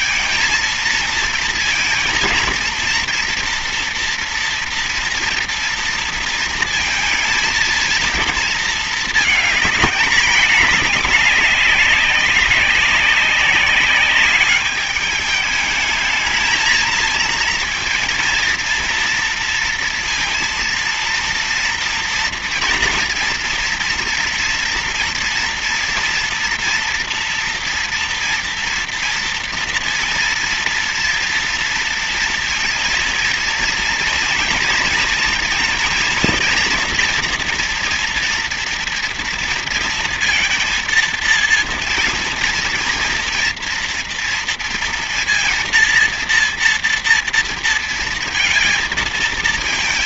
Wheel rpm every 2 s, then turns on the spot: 230, 230, 240, 230, 220, 210, 200, 200, 220, 230, 230, 230, 230, 240, 230, 230, 230, 240, 240, 230, 230, 240, 230, 230, 230.
none